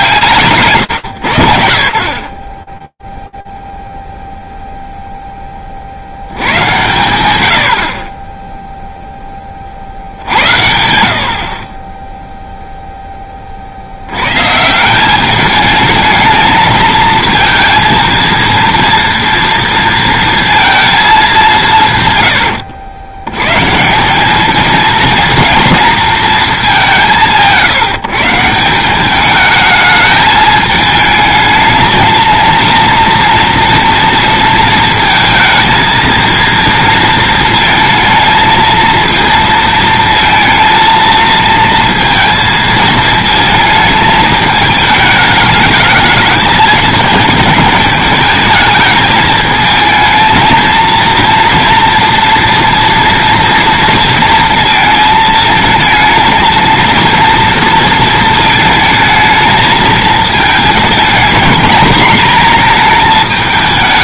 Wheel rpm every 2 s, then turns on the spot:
130, 10, 0, 100, 0, 70, 10, 180, 230, 230, 220, 100, 230, 190, 190, 220, 230, 230, 230, 230, 230, 220, 210, 220, 220, 230, 230, 220, 230, 220, 220, 220.
none